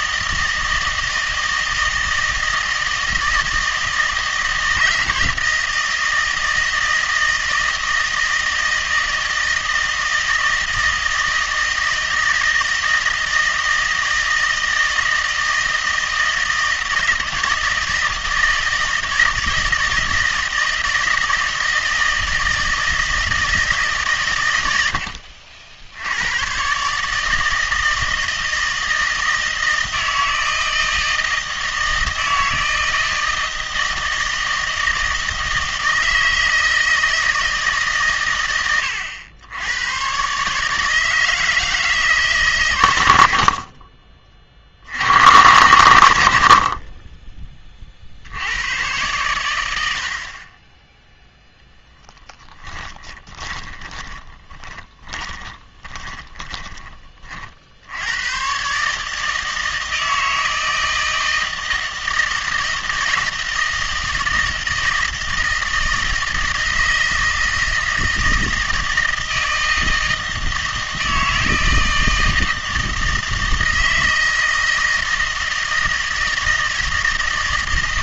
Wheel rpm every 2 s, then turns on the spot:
160, 160, 170, 160, 160, 160, 160, 160, 160, 160, 160, 160, 100, 130, 160, 160, 160, 160, 160, 100, 150, 120, 40, 60, 100, 10, 10, 20, 20, 130, 160, 160, 160, 160, 160, 160, 160, 160, 160.
52-56